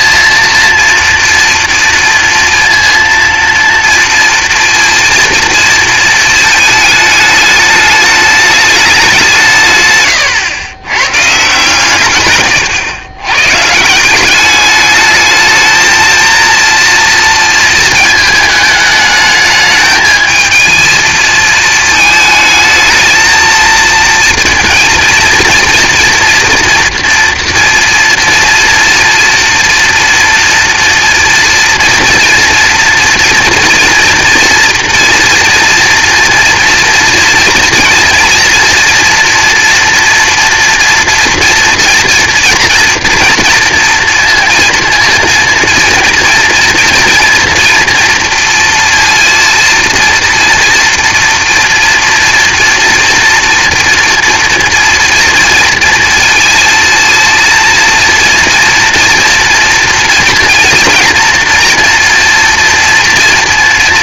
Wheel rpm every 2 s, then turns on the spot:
230, 230, 230, 230, 210, 130, 120, 190, 230, 220, 220, 220, 230, 230, 230, 230, 230, 230, 230, 230, 230, 230, 230, 230, 230, 230, 230, 230, 230, 230, 230, 230.
none